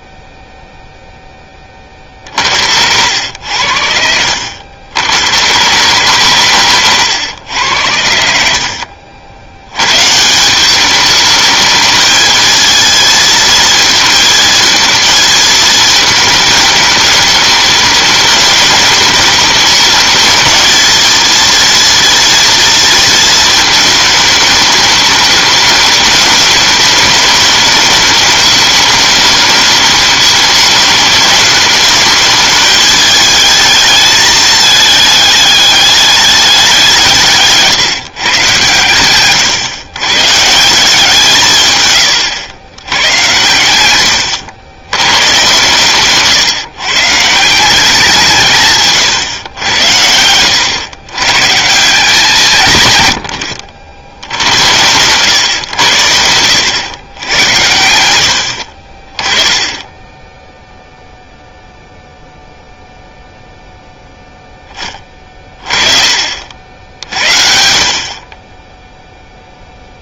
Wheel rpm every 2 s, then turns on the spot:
0, 30, 80, 120, 90, 120, 220, 230, 220, 210, 220, 240, 220, 210, 210, 210, 210, 220, 210, 160, 120, 120, 100, 140, 180, 100, 170, 80, 90, 90, 10, 0, 10, 50, 20.
42-44